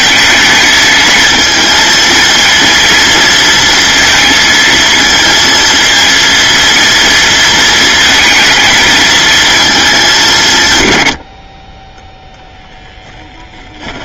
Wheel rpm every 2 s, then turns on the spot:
230, 230, 230, 230, 220, 110, 10.
12-14